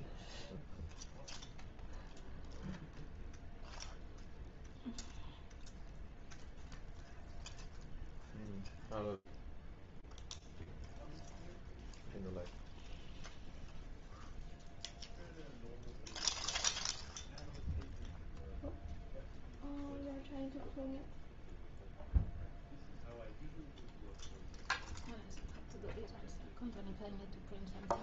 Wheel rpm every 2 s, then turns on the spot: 0, 0, 0, 0, 0, 0, 0, 0, 0, 0, 0, 0, 0, 0.
none